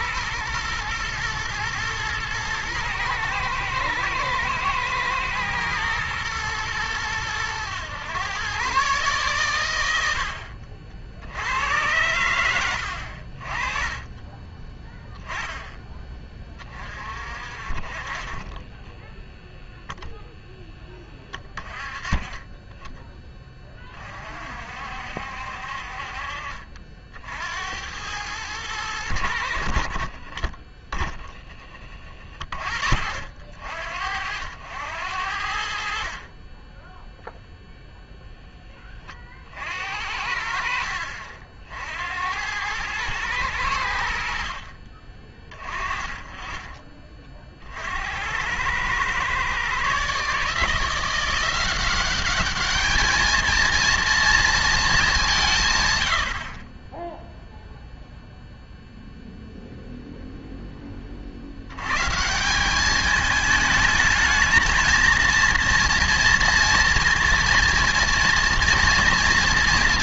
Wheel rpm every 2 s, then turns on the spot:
120, 110, 110, 110, 130, 60, 90, 10, 30, 20, 0, 20, 50, 50, 100, 30, 40, 80, 10, 10, 60, 100, 50, 30, 100, 160, 210, 230, 40, 0, 10, 190, 220, 230, 230.
none